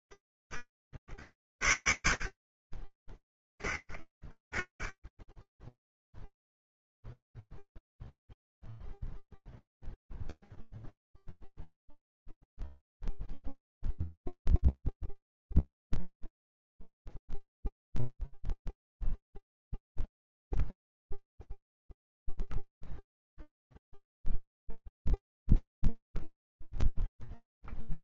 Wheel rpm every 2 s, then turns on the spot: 40, 50, 30, 0, 0, 0, 0, 0, 0, 0, 0, 0, 0, 0.
none